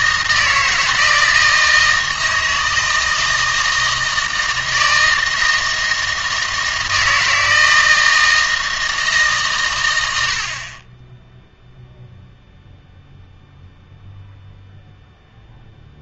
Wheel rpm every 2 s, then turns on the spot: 160, 160, 160, 160, 160, 40, 0, 0.
none